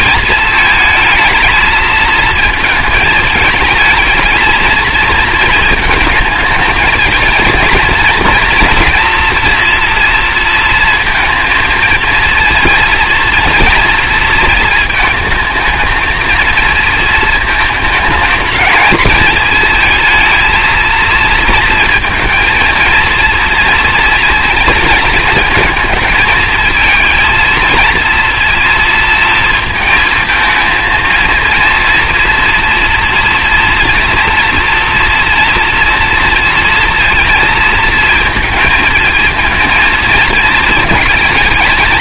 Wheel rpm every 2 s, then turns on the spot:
220, 220, 230, 220, 230, 230, 230, 220, 230, 220, 230, 230, 230, 220, 230, 230, 240, 230, 230, 220, 220.
none